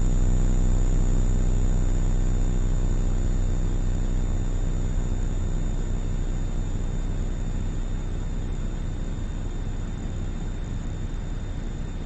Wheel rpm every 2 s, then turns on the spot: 0, 0, 0, 0, 0, 0.
none